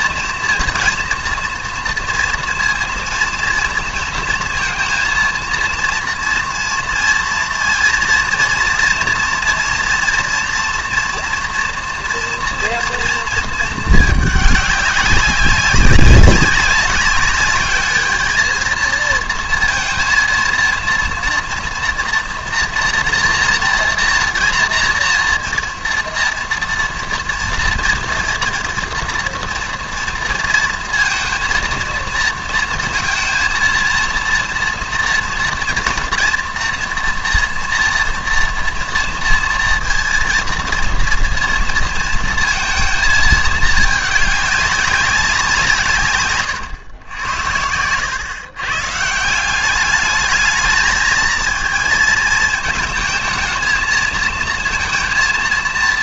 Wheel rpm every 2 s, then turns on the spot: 230, 230, 230, 240, 230, 230, 230, 200, 190, 220, 230, 230, 230, 240, 230, 230, 230, 230, 240, 230, 230, 230, 200, 130, 130, 220, 220, 220.
none